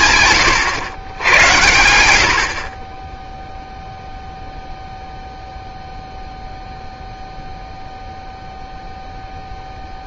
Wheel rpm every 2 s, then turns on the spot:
110, 10, 0, 0, 0.
0-2